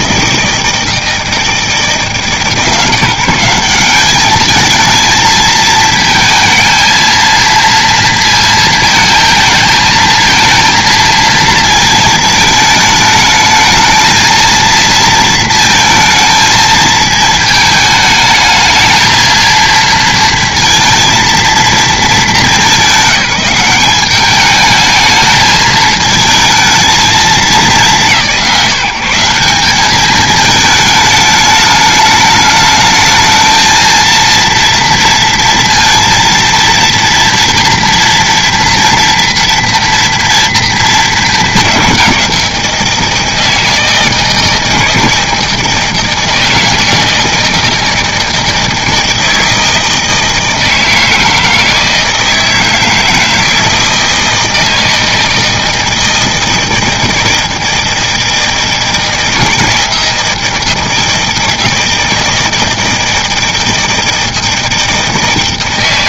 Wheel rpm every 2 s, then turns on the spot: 160, 160, 200, 220, 230, 220, 220, 220, 220, 220, 230, 220, 200, 220, 160, 210, 210, 230, 230, 230, 230, 190, 160, 160, 160, 160, 160, 160, 160, 160, 160, 160, 160.
none